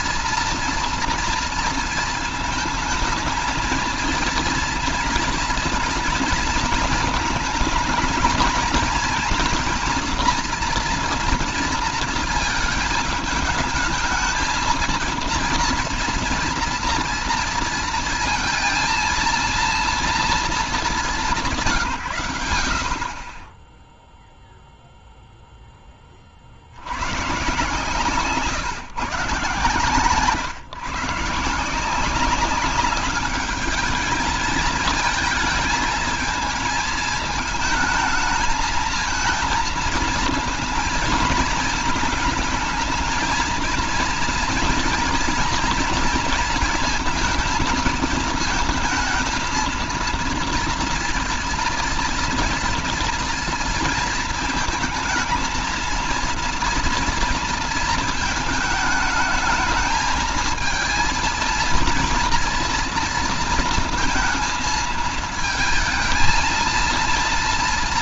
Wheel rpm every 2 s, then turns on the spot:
230, 220, 230, 220, 220, 230, 220, 230, 230, 230, 190, 40, 0, 130, 150, 150, 200, 220, 220, 220, 220, 220, 240, 230, 220, 230, 230, 220, 230, 220, 230, 230, 220, 230.
none